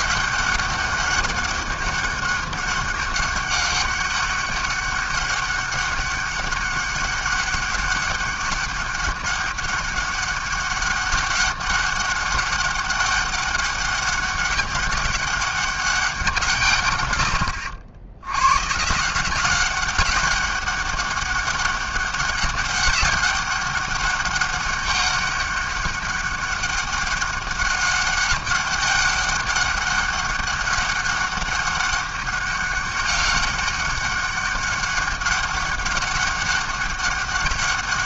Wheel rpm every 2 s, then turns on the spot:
200, 200, 200, 200, 200, 200, 190, 200, 170, 110, 200, 190, 200, 200, 200, 200, 200, 200, 200.
none